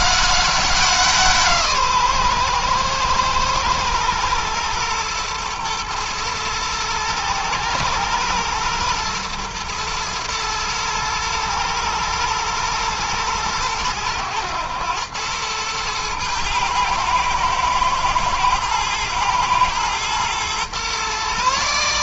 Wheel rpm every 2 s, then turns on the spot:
180, 120, 120, 110, 110, 110, 110, 100, 110, 110, 120.
none